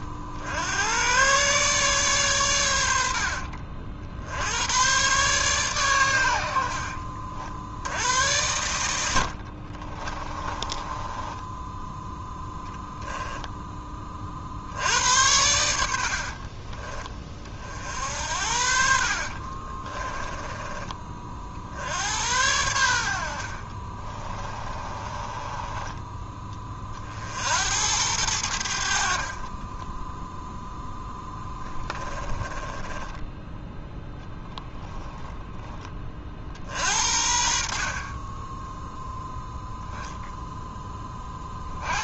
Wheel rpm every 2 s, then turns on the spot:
90, 90, 100, 80, 90, 20, 10, 70, 40, 60, 20, 90, 20, 30, 80, 0, 20, 10, 50, 10, 0.
10-14 16-18 24-26 32-34